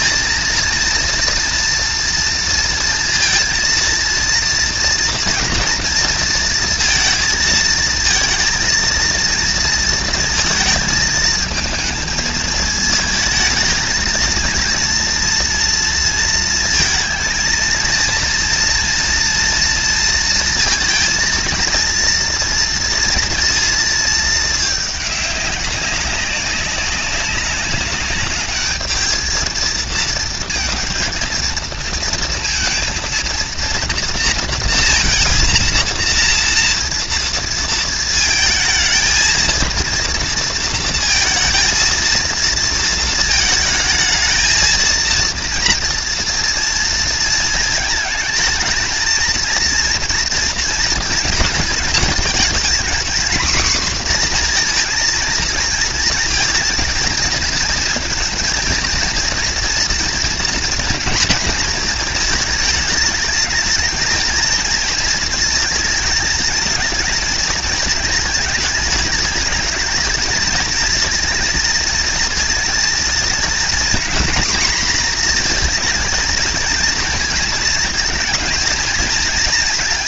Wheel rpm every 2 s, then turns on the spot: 230, 230, 230, 230, 220, 230, 230, 230, 230, 230, 230, 230, 230, 200, 200, 230, 230, 230, 230, 230, 230, 230, 220, 230, 220, 230, 220, 250, 230, 230, 230, 220, 220, 230, 220, 210, 230, 230, 230, 230.
none